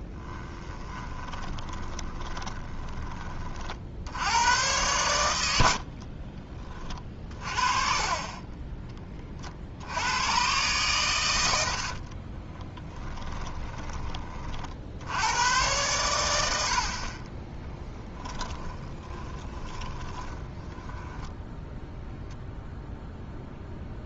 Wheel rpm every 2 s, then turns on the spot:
10, 20, 100, 30, 20, 120, 20, 60, 70, 20, 10, 0.
0-4 12-14 18-22